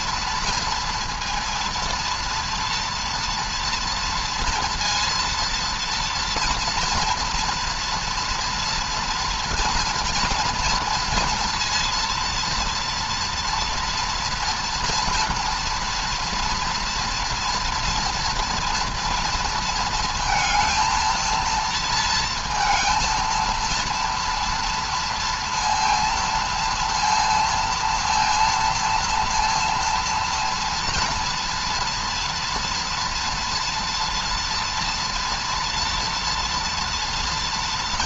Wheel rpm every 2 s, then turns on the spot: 230, 240, 230, 230, 240, 240, 230, 230, 230, 230, 230, 220, 230, 230, 230, 230, 230, 230, 230.
none